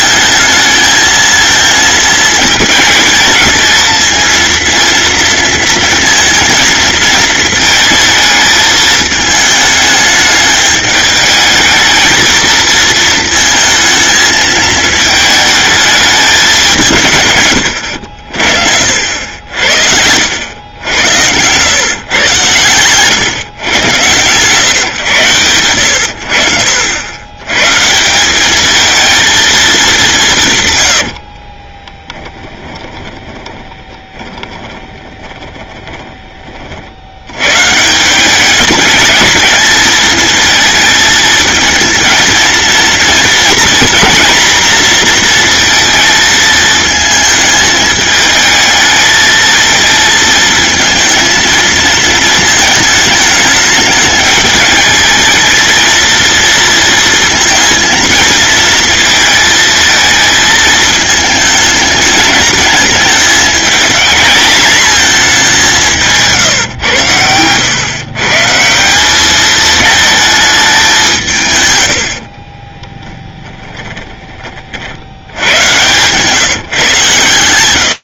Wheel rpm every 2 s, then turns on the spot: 220, 220, 230, 220, 220, 210, 220, 220, 170, 60, 90, 110, 130, 80, 220, 100, 20, 20, 50, 210, 220, 230, 240, 220, 220, 220, 220, 210, 230, 230, 220, 210, 220, 120, 180, 200, 20, 60, 140.
20-22 30-36 72-74